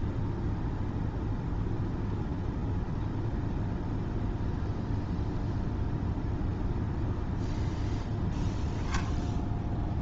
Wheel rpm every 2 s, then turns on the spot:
0, 0, 0, 0, 0.
none